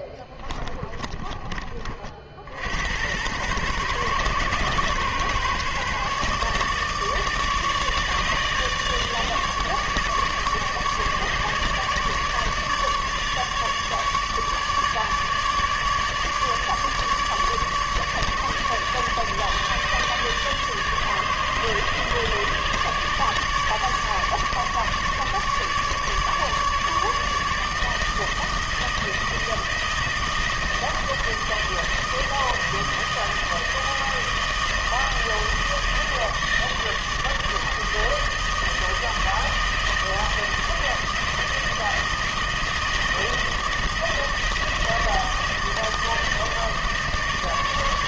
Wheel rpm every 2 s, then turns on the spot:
20, 80, 130, 150, 150, 150, 150, 150, 150, 150, 150, 150, 150, 150, 160, 160, 160, 160, 160, 160, 160, 160, 160, 160.
0-2